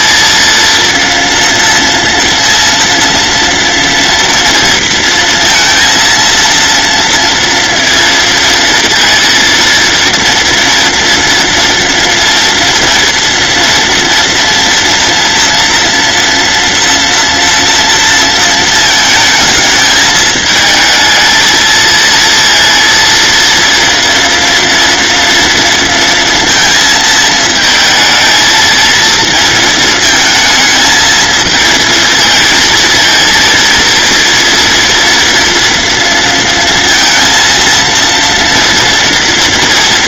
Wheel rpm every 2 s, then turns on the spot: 230, 230, 230, 230, 230, 230, 230, 230, 230, 220, 220, 230, 230, 230, 230, 220, 220, 230, 230, 230.
none